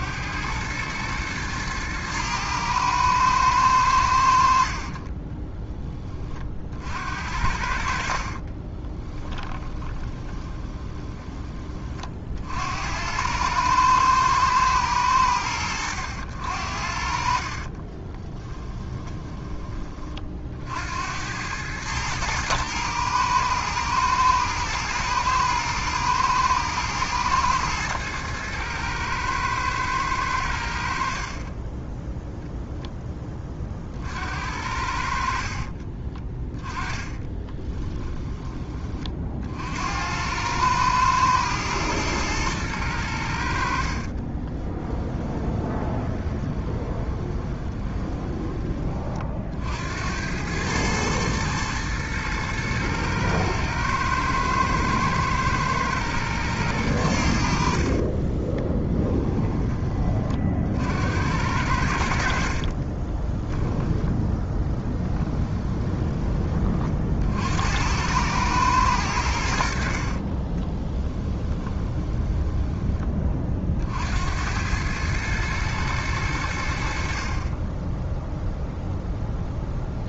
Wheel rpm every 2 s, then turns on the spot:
110, 110, 30, 60, 20, 20, 80, 100, 60, 10, 80, 110, 120, 110, 110, 60, 10, 60, 10, 30, 110, 100, 10, 20, 20, 110, 110, 110, 100, 20, 70, 40, 10, 50, 100, 20, 10, 100, 60, 0.
4-6 8-12 16-20 36-38 44-48 58-60 62-66 70-72